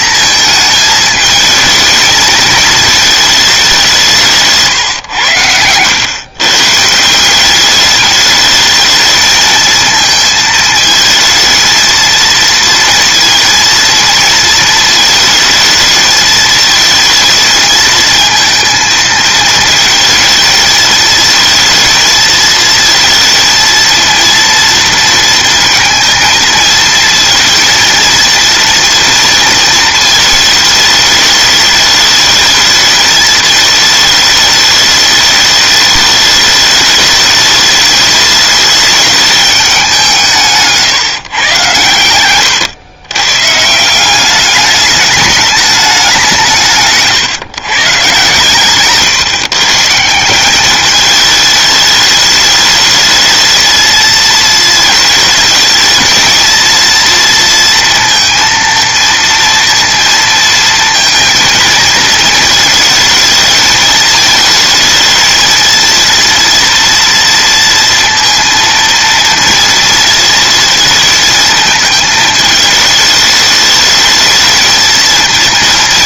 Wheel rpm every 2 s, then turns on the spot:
220, 220, 170, 110, 210, 220, 230, 230, 220, 220, 220, 220, 230, 220, 230, 220, 210, 210, 210, 210, 190, 110, 180, 190, 150, 170, 210, 220, 230, 230, 230, 220, 220, 230, 230, 230, 220, 220.
none